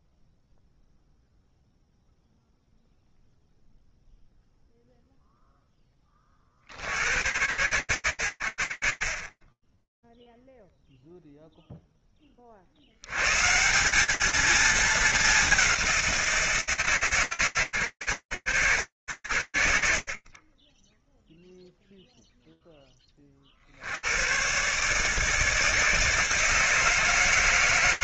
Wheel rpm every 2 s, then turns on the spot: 0, 0, 0, 90, 110, 10, 10, 200, 180, 100, 40, 0, 100, 160.
none